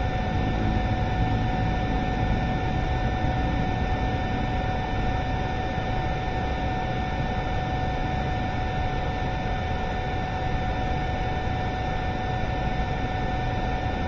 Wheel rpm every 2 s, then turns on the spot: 0, 0, 0, 0, 0, 0, 0.
none